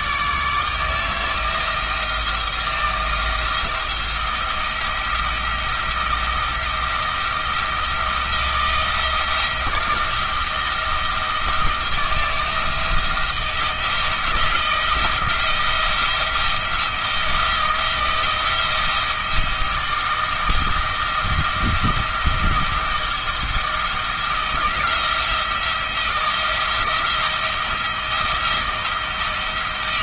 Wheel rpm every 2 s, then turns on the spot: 160, 160, 170, 170, 160, 170, 170, 170, 170, 160, 170, 170, 170, 170, 170.
none